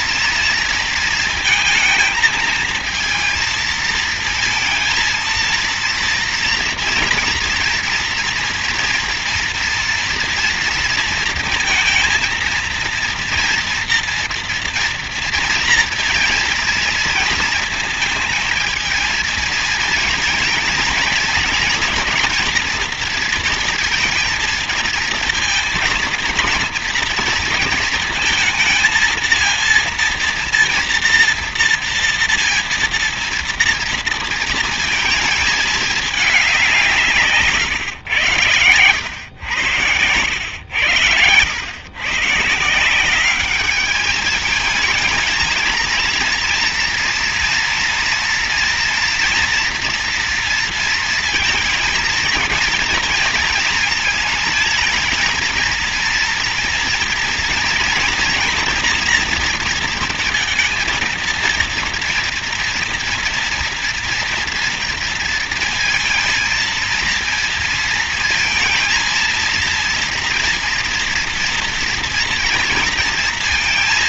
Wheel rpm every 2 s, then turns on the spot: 230, 230, 230, 230, 230, 230, 230, 230, 230, 220, 220, 230, 230, 230, 230, 230, 230, 220, 170, 100, 100, 170, 220, 230, 230, 230, 230, 230, 230, 240, 230, 230, 230, 230, 230, 230, 230.
none